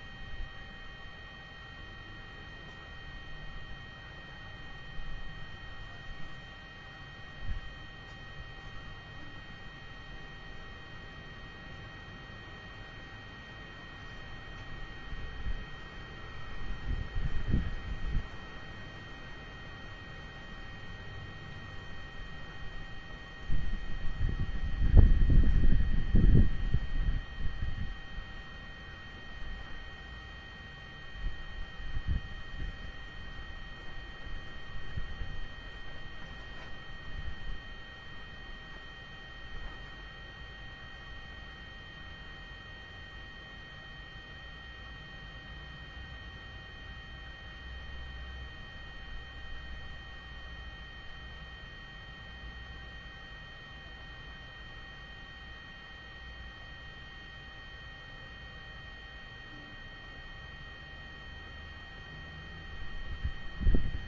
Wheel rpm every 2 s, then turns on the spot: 0, 0, 0, 0, 0, 0, 0, 0, 0, 0, 0, 0, 0, 0, 0, 0, 0, 0, 0, 0, 0, 0, 0, 0, 0, 0, 0, 0, 0, 0, 0, 0.
none